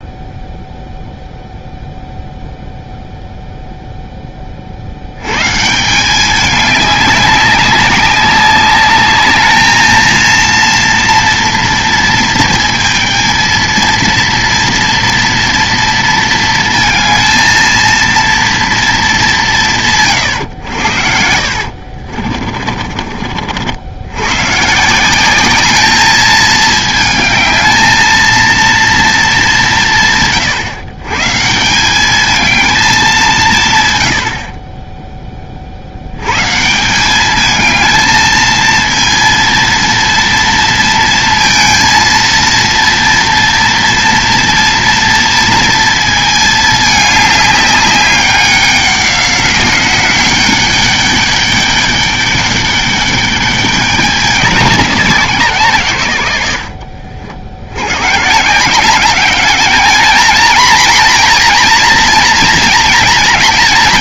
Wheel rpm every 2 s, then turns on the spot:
0, 0, 40, 200, 200, 230, 220, 230, 230, 230, 100, 40, 150, 220, 230, 140, 220, 30, 150, 230, 230, 230, 230, 210, 190, 200, 200, 190, 90, 170, 240, 240.
22-24